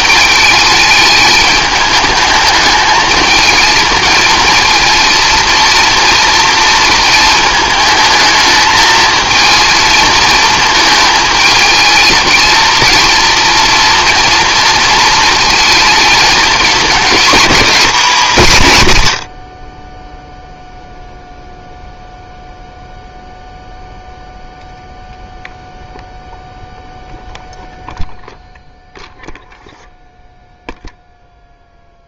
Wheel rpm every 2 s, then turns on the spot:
210, 210, 230, 230, 220, 220, 220, 230, 210, 110, 0, 0, 0, 0, 0, 0.
none